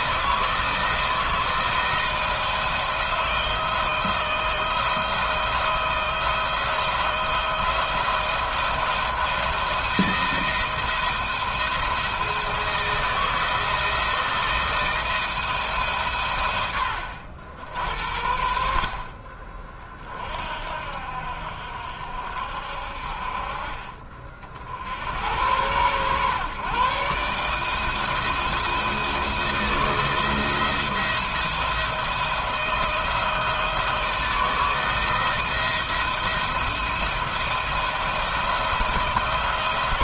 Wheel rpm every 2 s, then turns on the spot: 170, 170, 160, 170, 170, 170, 170, 170, 80, 50, 60, 60, 60, 130, 160, 170, 170, 160, 170, 160.
none